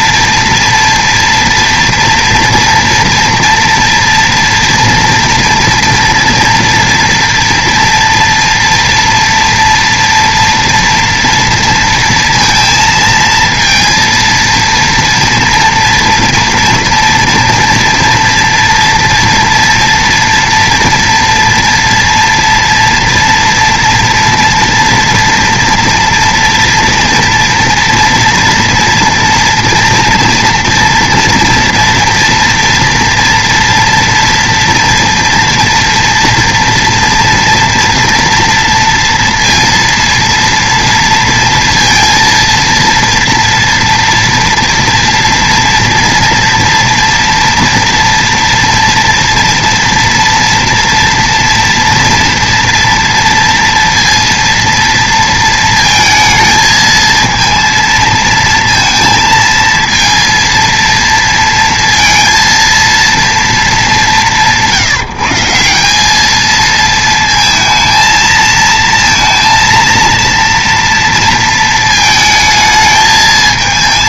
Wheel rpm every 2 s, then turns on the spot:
230, 230, 240, 230, 230, 230, 230, 230, 230, 230, 230, 230, 230, 230, 230, 230, 230, 230, 230, 230, 230, 230, 240, 230, 230, 240, 230, 230, 220, 230, 230, 230, 180, 220, 230, 230, 220.
none